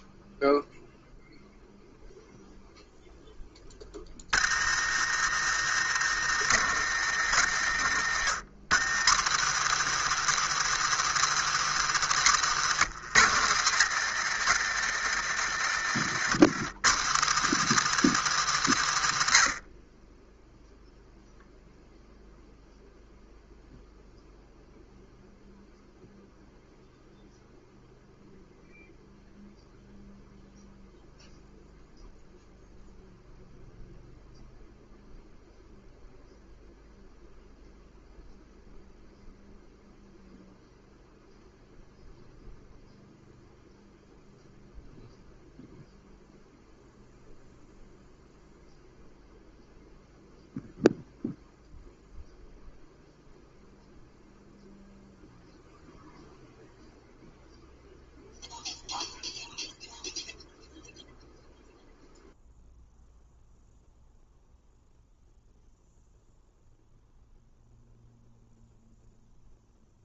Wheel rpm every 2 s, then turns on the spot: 0, 0, 70, 110, 110, 160, 140, 110, 110, 130, 0, 0, 0, 0, 0, 0, 0, 0, 0, 0, 0, 0, 0, 0, 0, 0, 0, 0, 0, 0, 0, 0, 0, 0, 0.
none